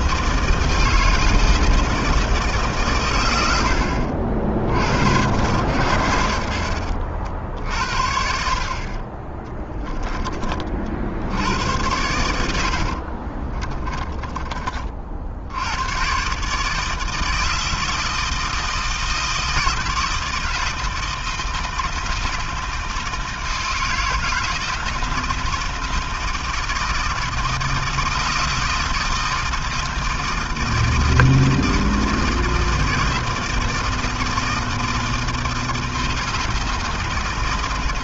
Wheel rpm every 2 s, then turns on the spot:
160, 90, 100, 50, 20, 90, 20, 70, 160, 160, 160, 160, 160, 160, 160, 160, 160, 160, 140.
8-10 12-14